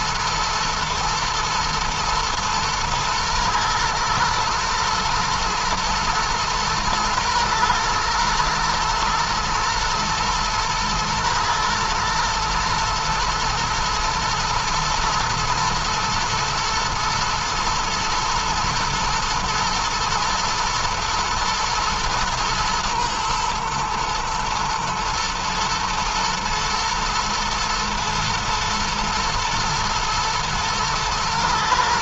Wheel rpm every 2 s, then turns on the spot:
120, 120, 110, 110, 120, 110, 110, 110, 110, 120, 110, 110, 120, 120, 110, 110.
none